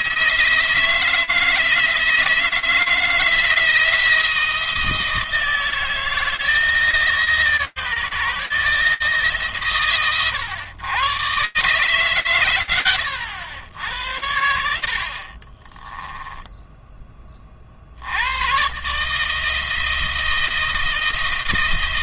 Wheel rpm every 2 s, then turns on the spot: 160, 170, 160, 160, 150, 120, 90, 60, 10, 140, 160.
14-16